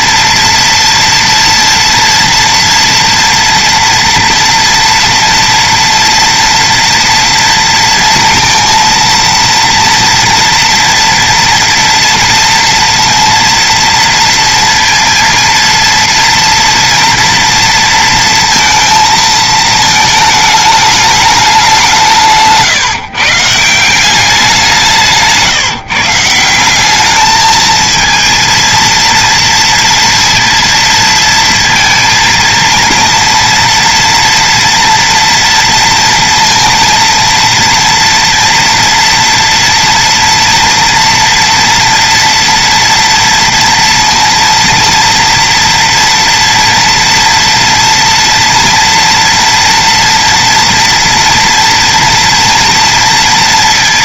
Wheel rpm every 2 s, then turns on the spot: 230, 230, 230, 230, 230, 230, 230, 230, 230, 230, 220, 190, 170, 160, 230, 230, 230, 230, 230, 230, 230, 230, 230, 230, 230, 230, 240.
none